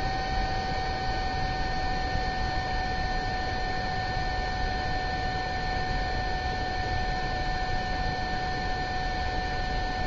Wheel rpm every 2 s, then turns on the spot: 0, 0, 0, 0, 0.
none